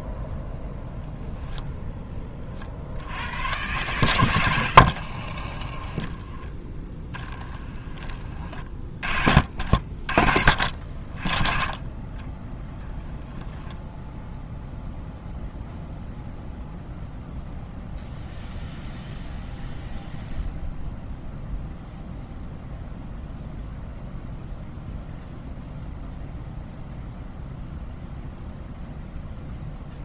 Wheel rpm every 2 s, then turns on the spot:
0, 60, 60, 20, 40, 40, 10, 0, 0, 0, 0, 0, 0, 0, 0.
4-6